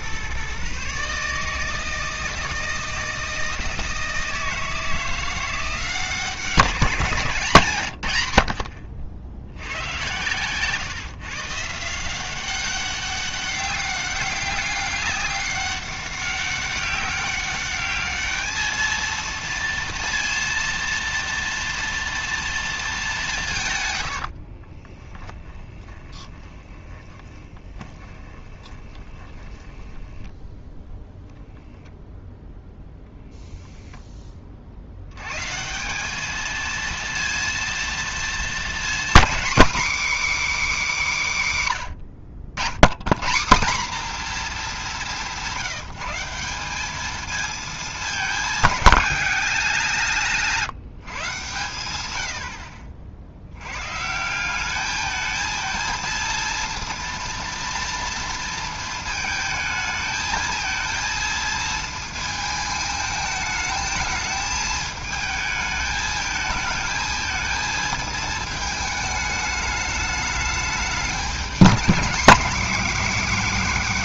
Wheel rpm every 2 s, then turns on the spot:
140, 160, 160, 190, 80, 130, 190, 200, 200, 220, 230, 220, 40, 20, 20, 10, 10, 50, 230, 240, 290, 100, 210, 190, 210, 170, 60, 200, 230, 230, 220, 220, 220, 220, 220, 210, 240.
24-30